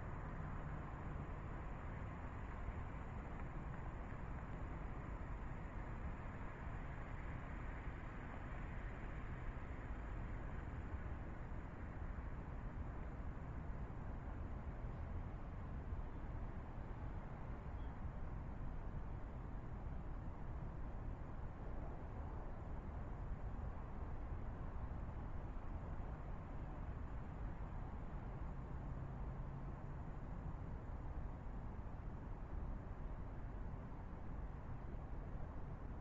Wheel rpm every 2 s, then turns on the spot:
0, 0, 0, 0, 0, 0, 0, 0, 0, 0, 0, 0, 0, 0, 0, 0, 0, 0.
none